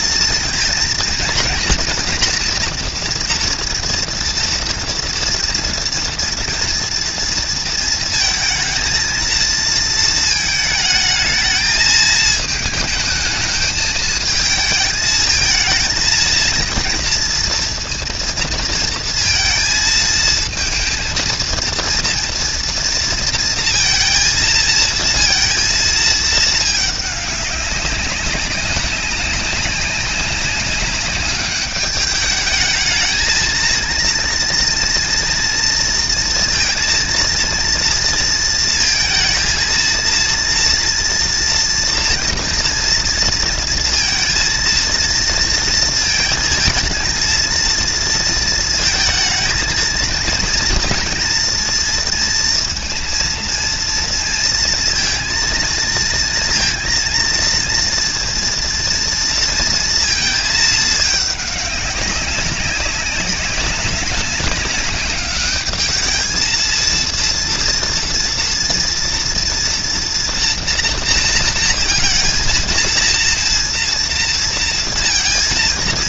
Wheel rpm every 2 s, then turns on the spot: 230, 230, 230, 230, 230, 230, 220, 220, 230, 230, 220, 230, 230, 230, 200, 190, 200, 230, 230, 230, 230, 230, 230, 230, 230, 230, 240, 230, 230, 230, 230, 190, 200, 210, 230, 230, 230, 230.
none